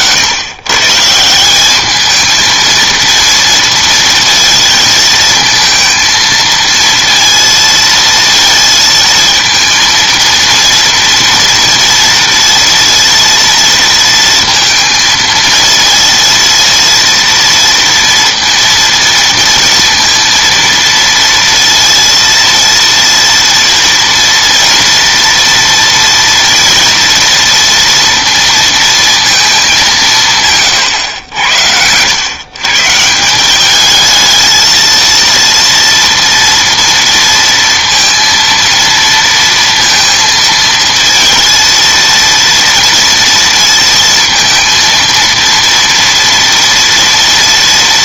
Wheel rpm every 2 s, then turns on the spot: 160, 230, 230, 230, 230, 230, 230, 220, 230, 230, 230, 230, 230, 230, 230, 100, 170, 230, 230, 230, 230, 230, 230, 230.
none